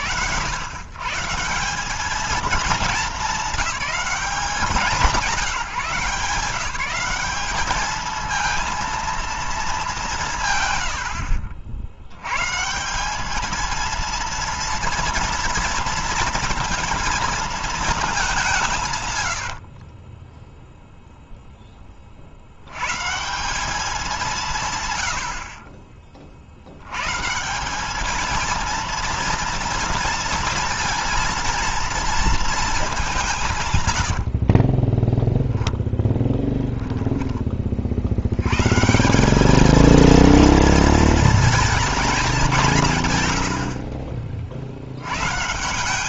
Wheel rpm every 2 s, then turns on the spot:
130, 220, 160, 180, 230, 80, 190, 230, 220, 110, 0, 160, 90, 150, 230, 230, 180, 10, 20, 190, 230, 120, 90.
10-12 18-20 34-36 42-44